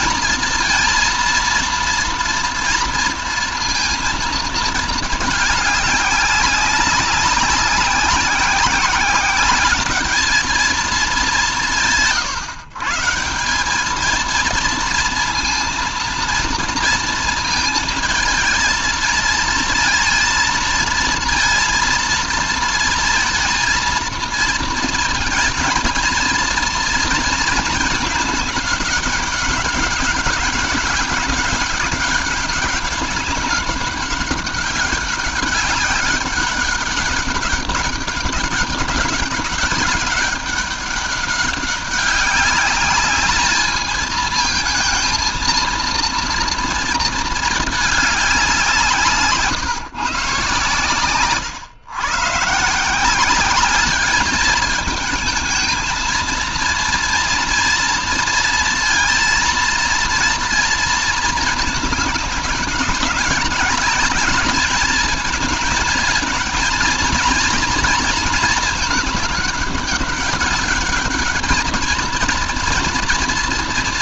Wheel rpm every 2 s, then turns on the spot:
230, 230, 220, 190, 190, 220, 130, 220, 230, 220, 230, 230, 230, 230, 210, 200, 200, 200, 200, 200, 200, 200, 220, 230, 170, 130, 150, 210, 230, 230, 230, 200, 210, 220, 220, 200, 230.
none